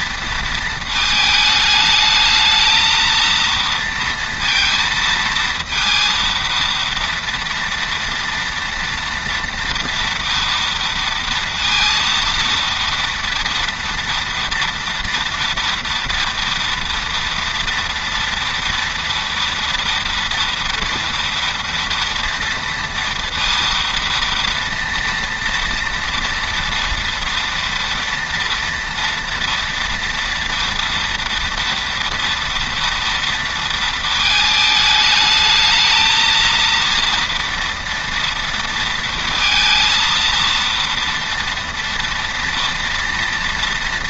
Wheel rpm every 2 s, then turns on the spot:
220, 230, 230, 230, 230, 230, 230, 230, 230, 230, 230, 230, 230, 230, 230, 230, 230, 210, 230, 230, 230, 230.
none